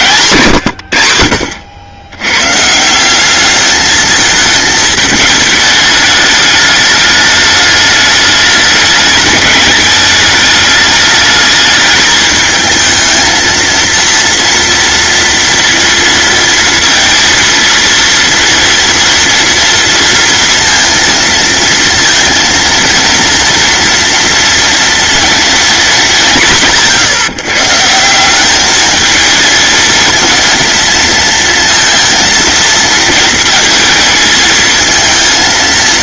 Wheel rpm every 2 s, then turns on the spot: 90, 160, 220, 210, 210, 210, 220, 230, 230, 230, 230, 230, 230, 140, 220, 230, 230, 220.
none